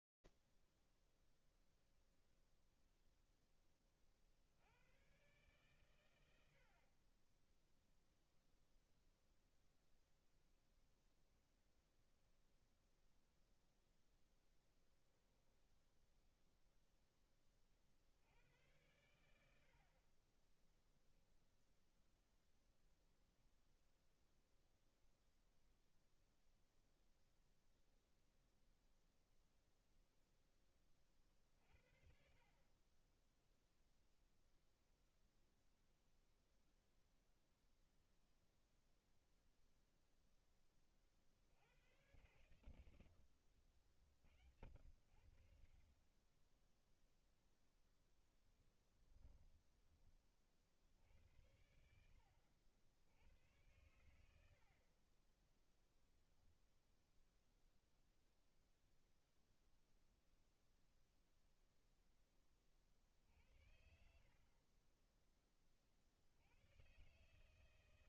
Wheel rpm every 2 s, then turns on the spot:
60, 110, 0, 0, 0, 0, 0, 30, 60, 10, 10, 0, 0, 0, 30, 30, 0, 0, 0, 10, 100, 60, 20, 10, 20, 70, 90, 10, 0, 0, 0, 50, 20, 140.
20-22 46-48